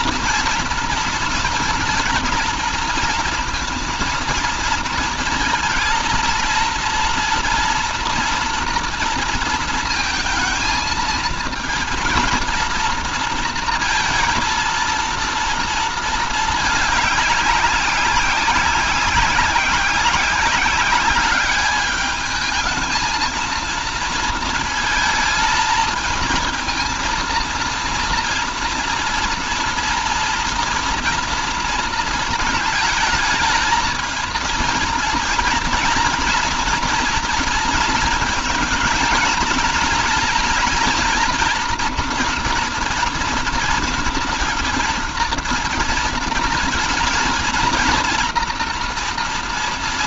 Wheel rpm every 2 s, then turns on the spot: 230, 230, 230, 230, 230, 230, 230, 230, 210, 190, 200, 220, 230, 230, 230, 240, 220, 230, 230, 220, 230, 240, 230, 230, 230.
none